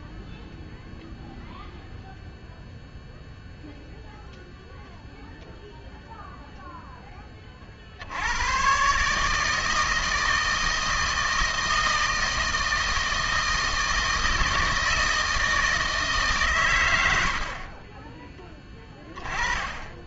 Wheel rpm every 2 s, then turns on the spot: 0, 0, 0, 0, 110, 160, 160, 160, 120, 10.
none